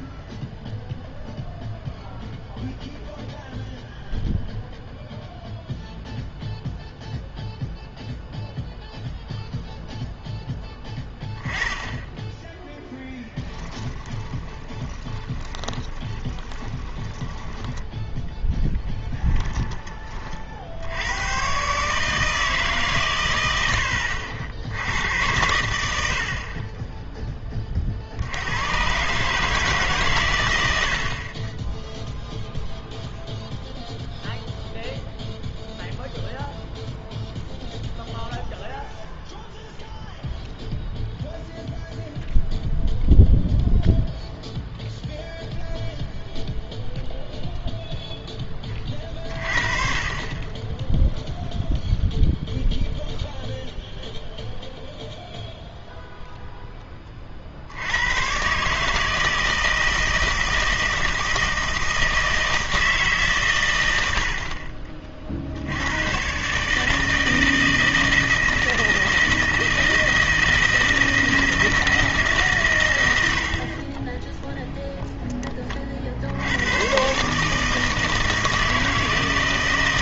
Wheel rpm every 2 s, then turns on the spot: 0, 0, 0, 0, 0, 10, 0, 20, 20, 10, 60, 140, 60, 40, 110, 100, 0, 0, 0, 0, 0, 0, 0, 0, 10, 20, 0, 0, 10, 130, 160, 160, 50, 150, 160, 160, 140, 0, 90, 160.
14-20